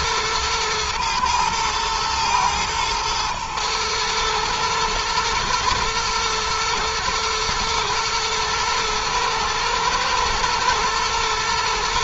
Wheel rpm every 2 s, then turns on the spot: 110, 110, 110, 120, 110, 120.
none